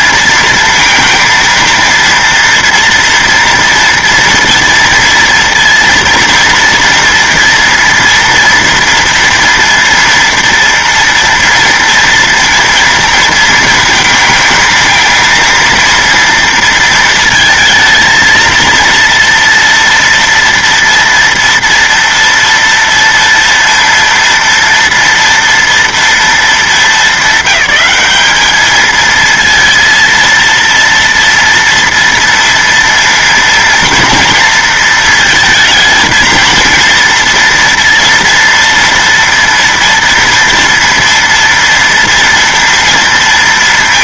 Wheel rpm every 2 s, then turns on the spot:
230, 230, 230, 230, 230, 230, 230, 220, 230, 230, 230, 230, 230, 220, 210, 230, 230, 230, 230, 230, 230, 230.
none